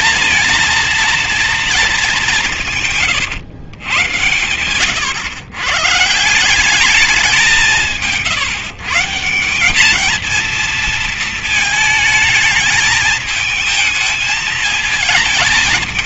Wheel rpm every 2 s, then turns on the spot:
230, 190, 110, 180, 170, 230, 220, 220.
none